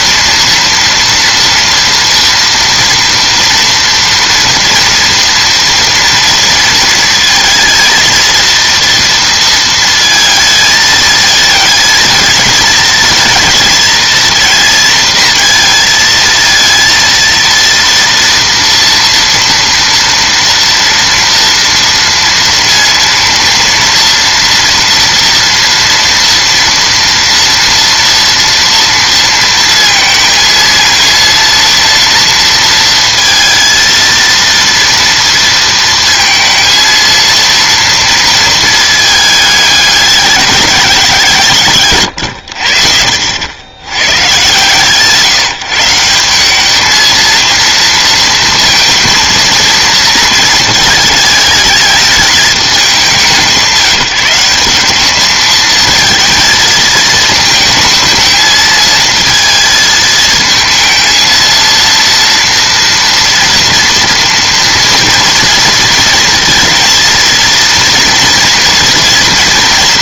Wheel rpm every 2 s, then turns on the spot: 230, 230, 230, 230, 230, 220, 220, 230, 230, 230, 230, 230, 230, 230, 230, 230, 230, 230, 230, 230, 200, 70, 140, 210, 230, 220, 210, 190, 220, 220, 220, 230, 230, 230, 230.
none